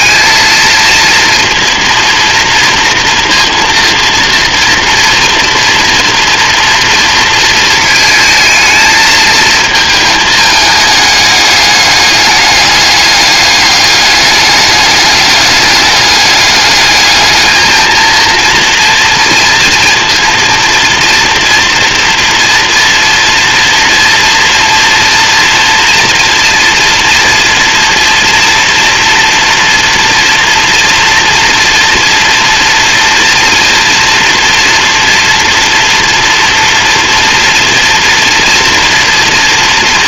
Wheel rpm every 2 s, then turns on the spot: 230, 230, 230, 230, 220, 210, 200, 210, 210, 230, 230, 240, 230, 240, 230, 230, 230, 240, 230, 230.
none